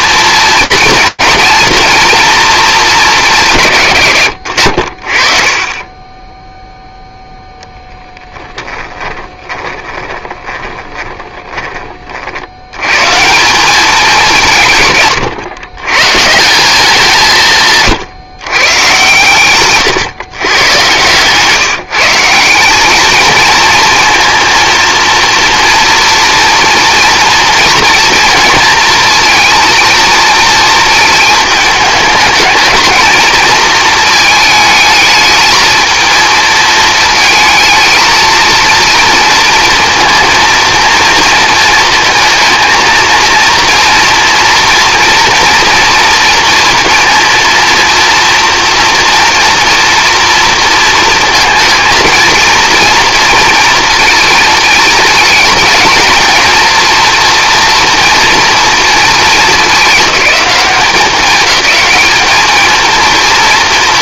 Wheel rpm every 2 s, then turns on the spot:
230, 220, 70, 0, 10, 20, 90, 150, 190, 130, 120, 190, 240, 240, 230, 220, 220, 220, 220, 230, 230, 220, 230, 230, 230, 230, 230, 220, 230, 220, 200, 220.
8-12